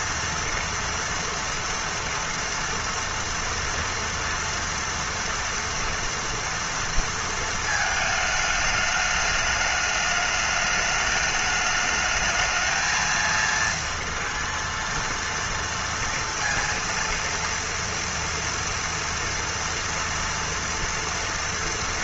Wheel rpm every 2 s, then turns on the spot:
230, 230, 230, 230, 220, 210, 220, 230, 230, 230, 230.
none